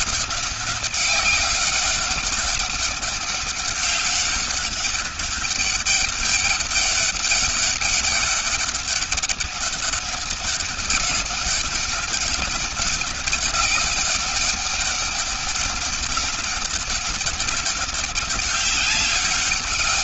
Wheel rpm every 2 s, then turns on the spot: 190, 200, 200, 200, 200, 200, 200, 200, 200, 200.
none